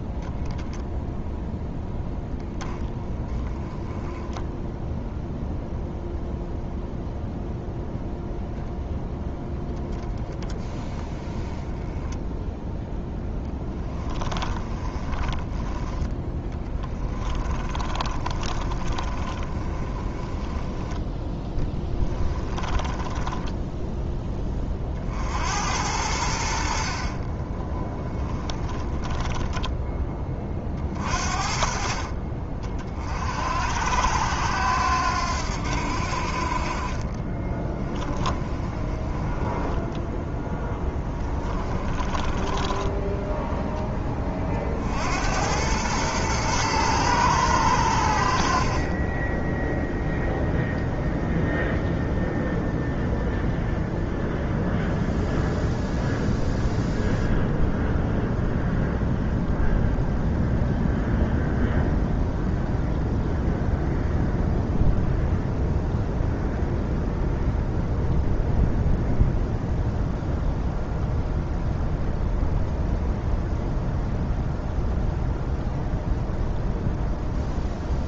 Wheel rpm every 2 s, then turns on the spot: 0, 10, 0, 0, 0, 10, 0, 10, 10, 30, 10, 20, 30, 70, 20, 30, 40, 90, 50, 20, 0, 10, 40, 110, 50, 0, 0, 0, 0, 0, 0, 0, 0, 0, 0, 0, 0, 0, 0.
14-24 28-30 38-40